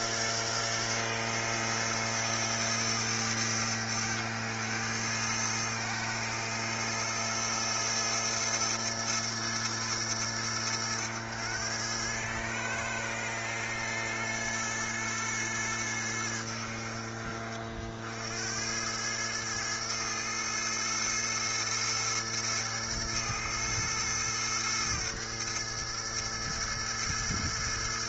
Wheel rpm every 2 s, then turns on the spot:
110, 100, 100, 110, 110, 100, 110, 110, 60, 100, 110, 110, 110, 110.
none